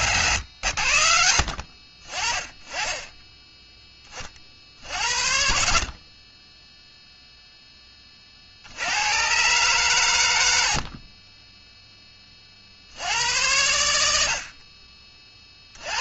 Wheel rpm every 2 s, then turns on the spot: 30, 30, 20, 30, 110, 10, 90, 70.
none